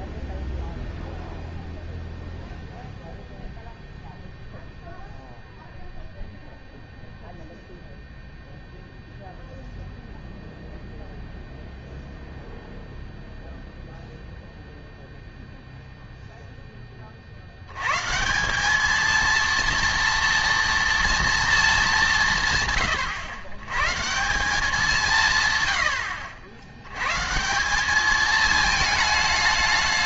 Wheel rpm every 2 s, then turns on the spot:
0, 0, 0, 0, 0, 0, 0, 0, 10, 200, 230, 130, 190, 90, 220.
none